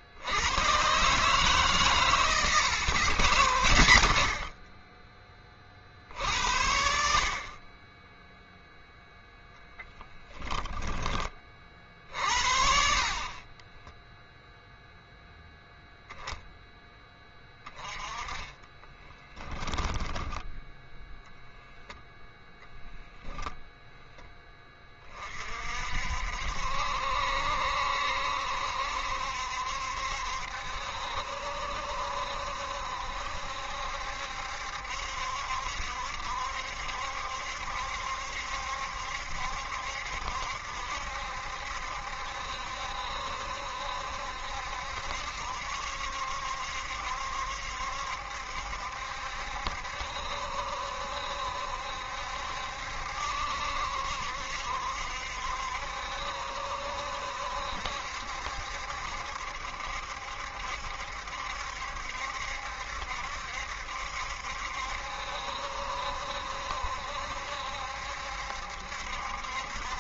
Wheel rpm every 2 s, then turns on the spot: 110, 130, 30, 60, 0, 10, 50, 0, 10, 20, 10, 0, 20, 70, 70, 70, 70, 70, 70, 70, 70, 70, 70, 70, 70, 70, 70, 70, 70, 70, 70, 70, 70, 70, 70.
18-20